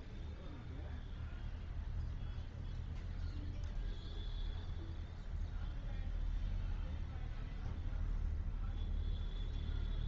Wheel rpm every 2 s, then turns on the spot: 0, 0, 0, 0, 0.
none